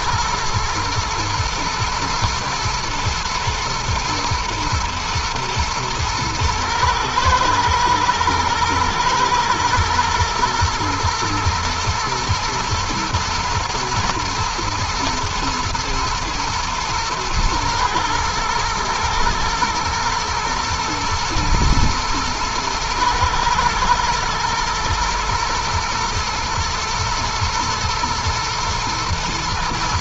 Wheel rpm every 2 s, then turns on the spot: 110, 110, 120, 110, 110, 110, 110, 110, 120, 110, 110, 110, 110, 110, 120.
none